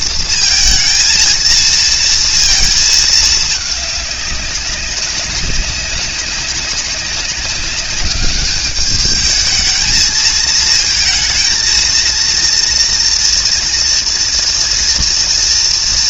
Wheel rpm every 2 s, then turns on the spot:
230, 220, 200, 200, 200, 220, 230, 230.
none